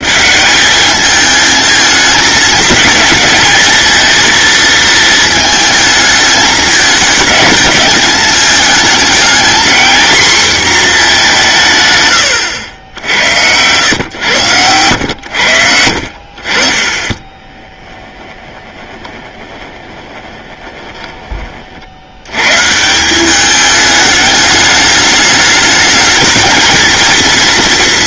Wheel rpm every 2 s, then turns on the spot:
210, 220, 220, 220, 210, 230, 80, 100, 40, 10, 20, 150, 210, 220.
18-22